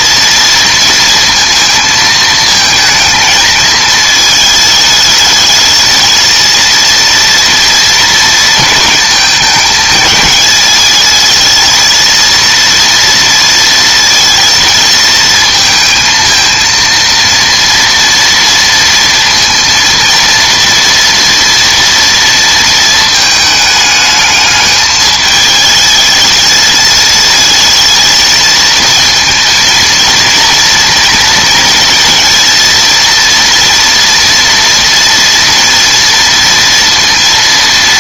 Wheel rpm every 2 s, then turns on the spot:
230, 220, 220, 230, 230, 220, 230, 230, 230, 230, 230, 230, 210, 220, 230, 230, 230, 230, 230.
none